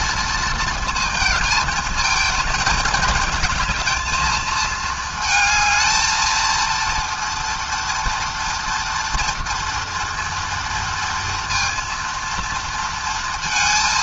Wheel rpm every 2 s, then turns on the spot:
230, 220, 220, 230, 240, 230, 230.
none